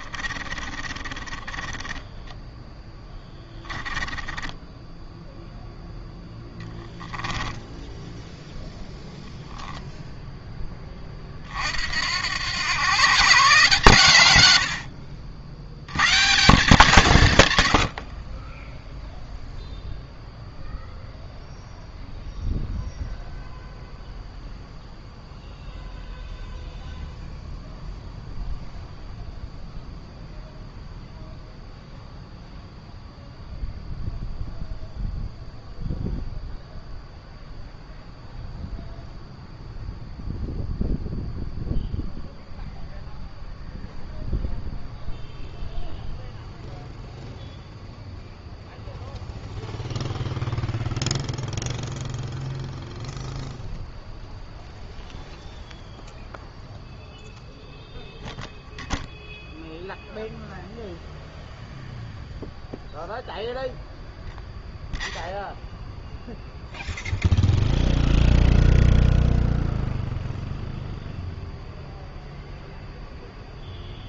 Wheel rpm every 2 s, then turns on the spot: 30, 10, 10, 10, 0, 20, 120, 80, 160, 10, 0, 0, 0, 0, 0, 0, 0, 0, 0, 0, 0, 0, 0, 0, 0, 0, 0, 0, 0, 0, 0, 0, 0, 0, 0, 0, 0.
0-8